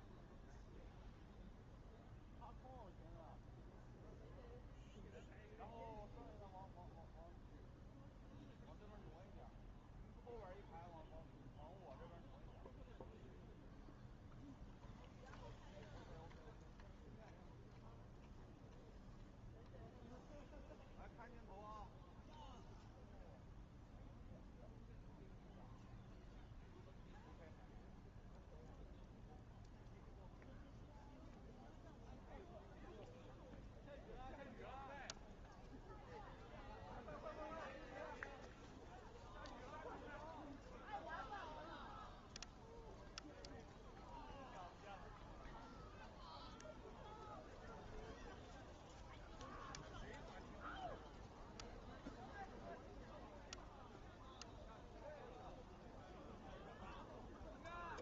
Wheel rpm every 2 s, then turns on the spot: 0, 0, 0, 0, 0, 0, 0, 0, 0, 0, 0, 0, 0, 0, 0, 0, 0, 0, 0, 0, 0, 0, 0, 0, 0, 0, 0, 0, 0.
none